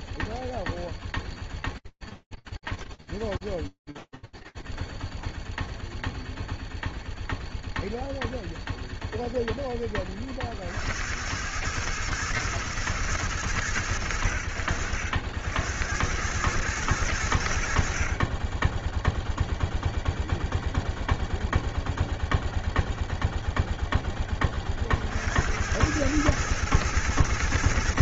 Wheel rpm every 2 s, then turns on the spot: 0, 0, 0, 0, 0, 90, 110, 70, 90, 0, 0, 0, 60, 110.
none